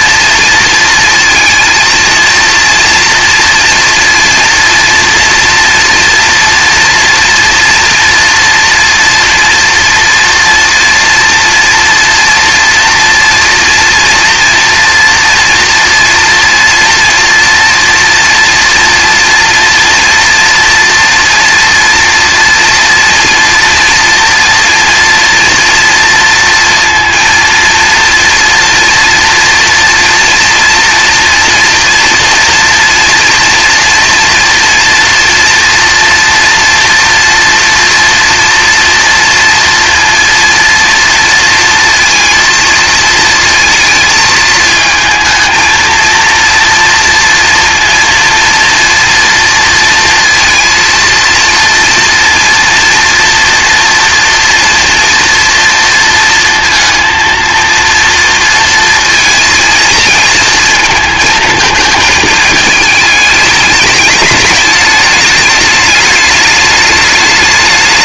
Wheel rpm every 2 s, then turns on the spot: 230, 230, 230, 240, 230, 230, 240, 230, 230, 230, 230, 240, 230, 230, 230, 230, 230, 230, 240, 230, 230, 220, 220, 230, 230, 230, 230, 230, 230, 230, 220, 210, 210, 210.
none